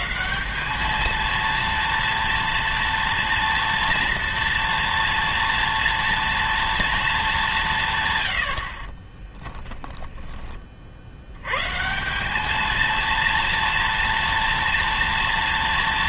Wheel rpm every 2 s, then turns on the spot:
190, 230, 230, 230, 50, 40, 220, 230.
none